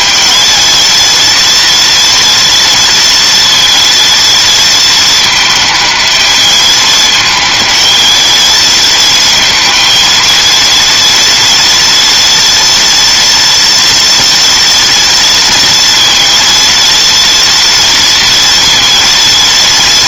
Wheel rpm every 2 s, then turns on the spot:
230, 230, 230, 220, 220, 230, 230, 230, 230, 230.
none